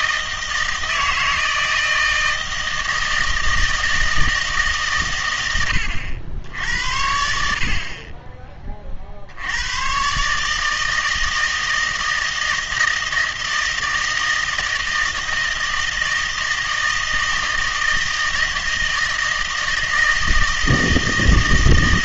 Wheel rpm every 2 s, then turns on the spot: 160, 160, 140, 80, 30, 150, 160, 160, 160, 160, 160.
none